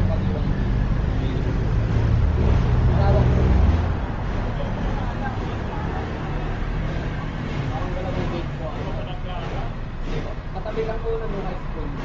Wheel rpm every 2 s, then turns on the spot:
0, 0, 0, 0, 0, 0.
none